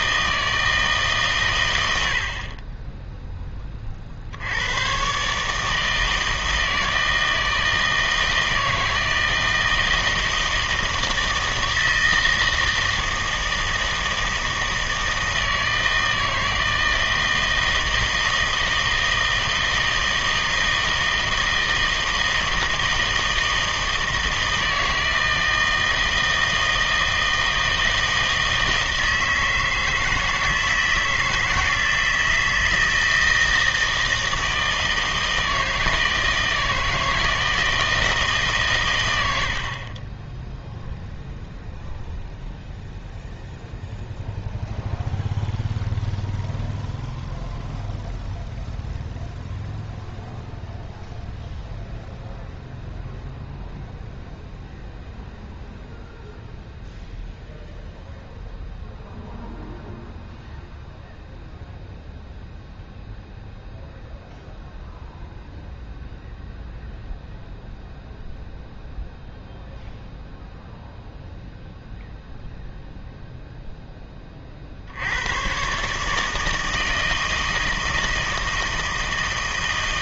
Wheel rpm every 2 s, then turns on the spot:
160, 20, 100, 160, 160, 160, 160, 160, 160, 160, 160, 160, 160, 160, 160, 160, 160, 160, 160, 130, 0, 0, 0, 0, 0, 0, 0, 0, 0, 0, 0, 0, 0, 0, 0, 0, 0, 50, 160, 160.
none